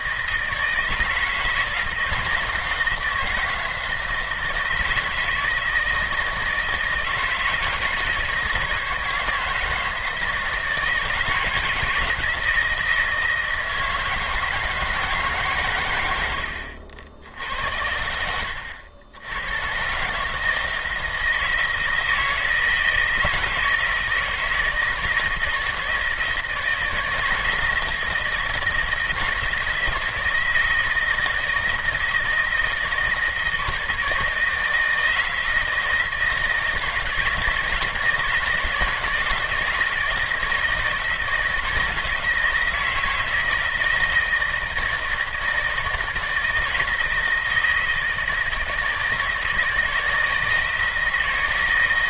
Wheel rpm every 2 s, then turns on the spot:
160, 160, 160, 160, 160, 160, 160, 160, 70, 80, 160, 160, 160, 160, 160, 160, 160, 160, 160, 160, 160, 160, 160, 160, 160, 160.
16-20